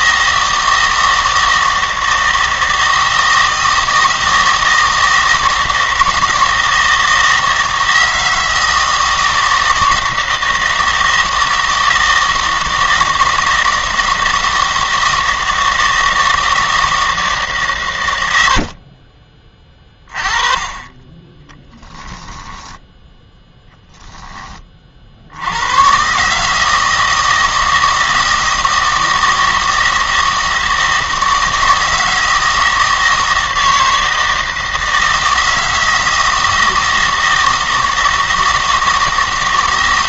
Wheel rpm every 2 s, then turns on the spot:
160, 160, 160, 160, 160, 160, 160, 160, 160, 70, 20, 10, 30, 160, 160, 160, 160, 160, 160, 160.
18-20